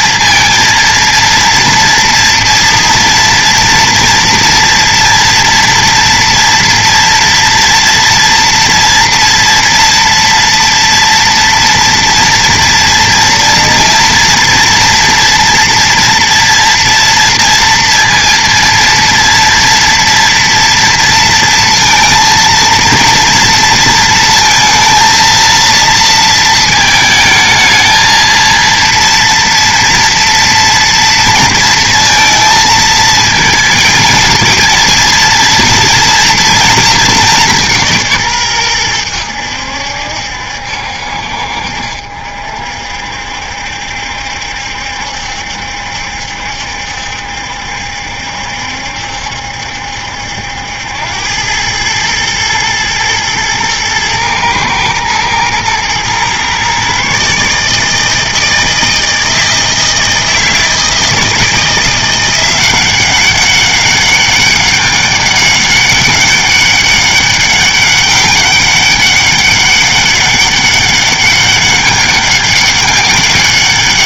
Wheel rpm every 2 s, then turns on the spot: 230, 230, 230, 230, 230, 230, 230, 230, 240, 230, 230, 230, 230, 220, 230, 230, 220, 230, 230, 110, 70, 60, 70, 70, 70, 80, 110, 110, 130, 160, 160, 180, 200, 200, 200, 200, 200.
none